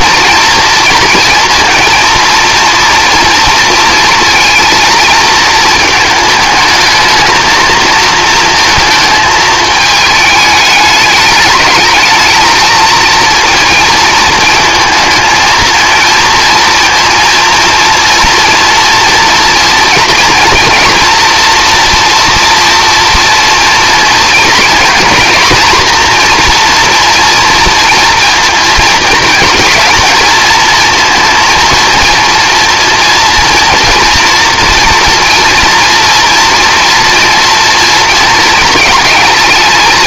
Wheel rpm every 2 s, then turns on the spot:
230, 230, 230, 220, 230, 210, 230, 220, 230, 240, 240, 240, 230, 240, 230, 230, 230, 230, 230, 220.
none